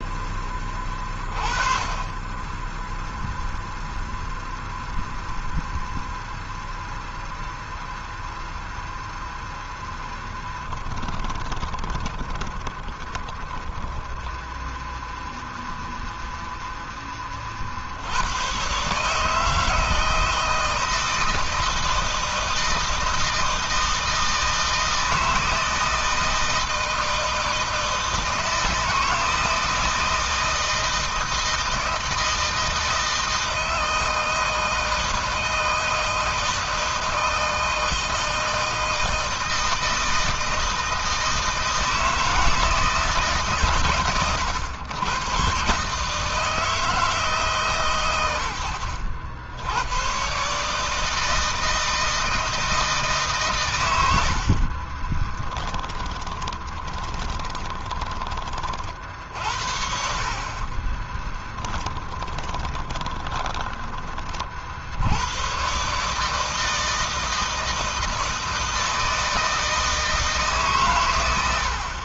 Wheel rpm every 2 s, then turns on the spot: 10, 10, 0, 0, 0, 20, 20, 10, 0, 110, 160, 160, 160, 160, 160, 160, 160, 160, 160, 160, 160, 160, 100, 160, 100, 140, 160, 60, 30, 30, 40, 20, 40, 150, 160, 140.
10-16 54-58 60-64